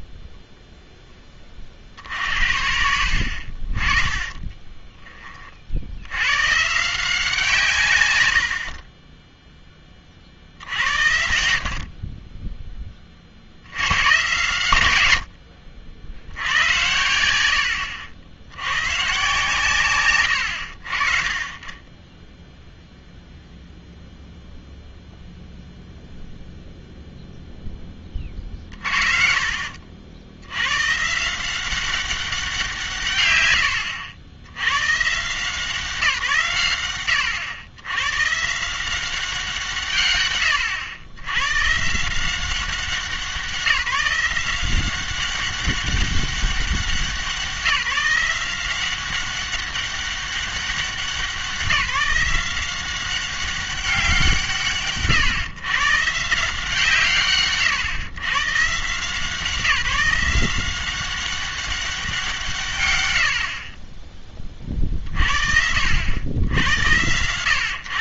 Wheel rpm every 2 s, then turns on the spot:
0, 60, 10, 140, 50, 70, 10, 110, 90, 100, 60, 0, 0, 0, 60, 110, 170, 120, 120, 160, 110, 190, 180, 190, 180, 190, 180, 150, 160, 150, 180, 160, 40, 110.
4-6 28-30